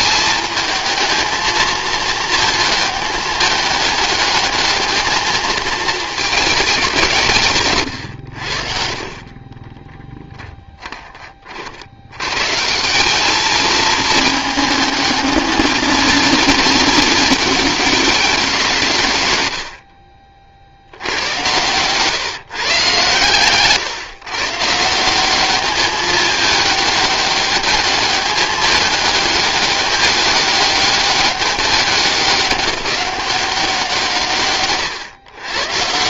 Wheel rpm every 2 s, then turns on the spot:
220, 220, 220, 180, 50, 20, 180, 220, 220, 160, 80, 140, 170, 210, 210, 200, 200, 130.
none